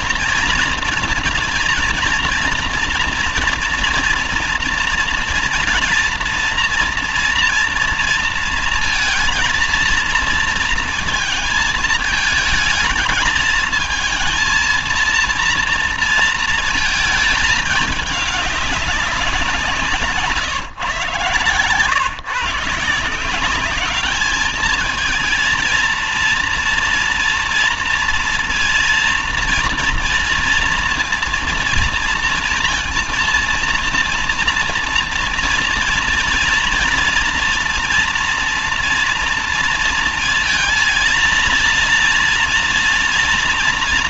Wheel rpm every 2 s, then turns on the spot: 230, 230, 230, 240, 230, 230, 220, 230, 230, 190, 130, 170, 220, 230, 230, 230, 230, 230, 230, 230, 230, 230.
none